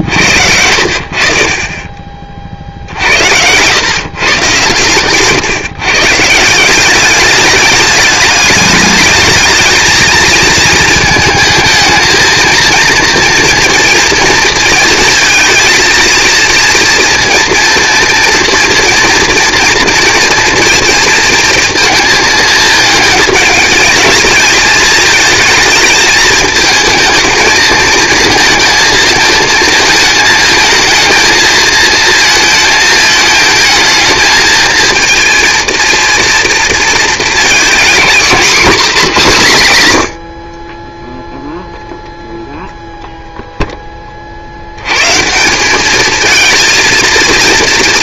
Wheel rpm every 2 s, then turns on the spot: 70, 50, 120, 180, 210, 230, 230, 220, 230, 230, 240, 220, 220, 220, 220, 220, 220, 220, 230, 220, 30, 0, 70, 230.
none